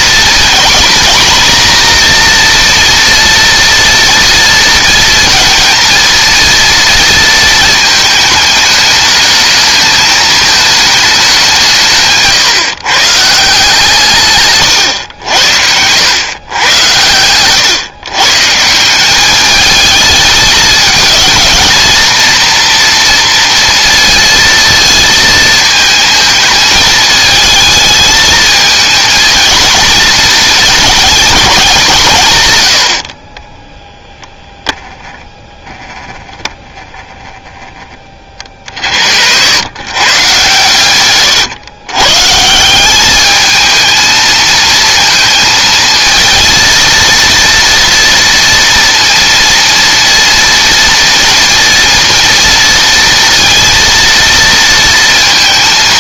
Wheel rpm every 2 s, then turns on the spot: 240, 240, 230, 230, 210, 220, 130, 130, 100, 160, 210, 230, 230, 220, 220, 220, 110, 0, 10, 50, 120, 180, 230, 230, 230, 240, 230, 230.
none